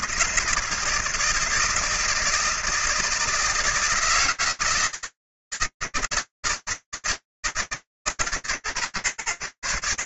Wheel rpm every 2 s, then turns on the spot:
160, 160, 160, 160, 140.
none